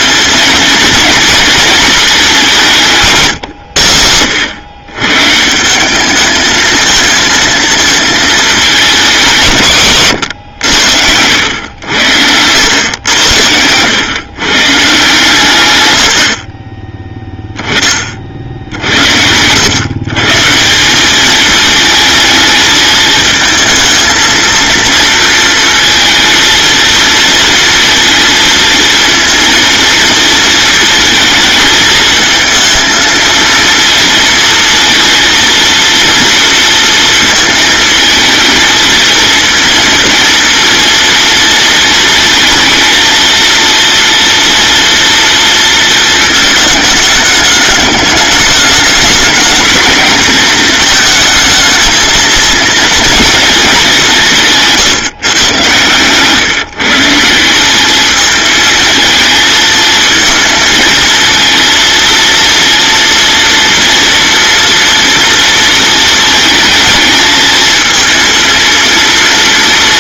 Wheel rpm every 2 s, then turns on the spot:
230, 150, 130, 220, 190, 90, 100, 140, 10, 80, 200, 220, 230, 230, 230, 230, 230, 230, 230, 220, 230, 230, 230, 210, 220, 220, 230, 140, 160, 220, 230, 240, 230, 220, 230.
none